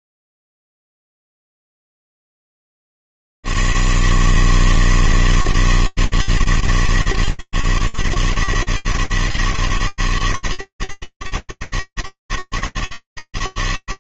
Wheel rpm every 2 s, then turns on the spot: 80, 160, 160, 160, 140, 160, 160.
none